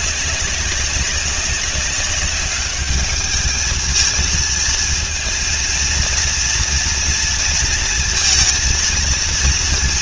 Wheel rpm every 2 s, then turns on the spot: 190, 210, 230, 230, 230.
none